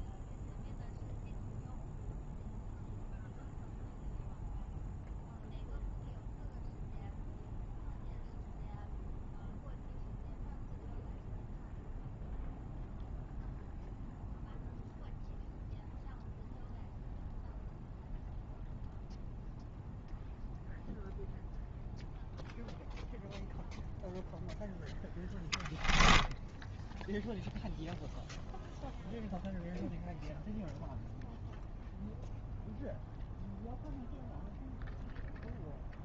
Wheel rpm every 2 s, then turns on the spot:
0, 0, 0, 0, 0, 0, 0, 0, 0, 0, 0, 0, 0, 10, 0, 0, 0, 0.
none